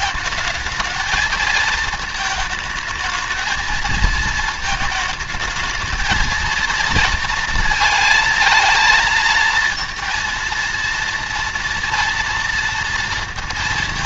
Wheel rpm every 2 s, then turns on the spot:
220, 220, 220, 230, 230, 230, 230.
none